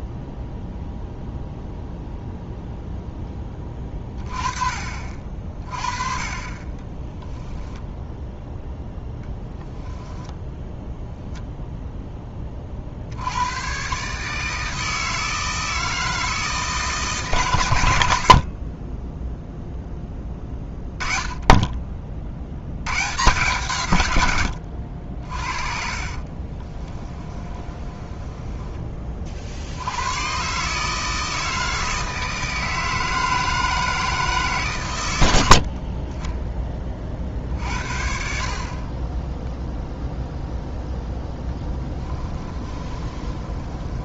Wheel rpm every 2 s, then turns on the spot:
0, 0, 40, 20, 0, 0, 50, 160, 150, 20, 20, 110, 70, 20, 20, 150, 160, 110, 20, 40, 0, 20.
6-8 26-28 42-44